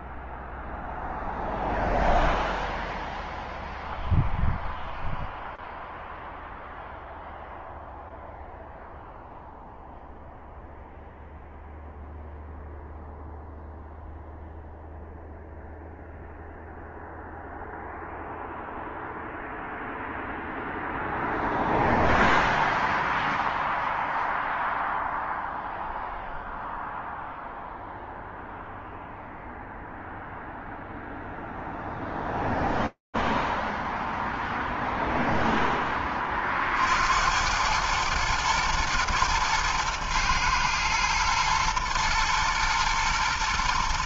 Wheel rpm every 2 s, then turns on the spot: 0, 0, 0, 0, 0, 0, 0, 0, 0, 0, 0, 0, 0, 0, 0, 0, 0, 0, 40, 120, 110, 120.
none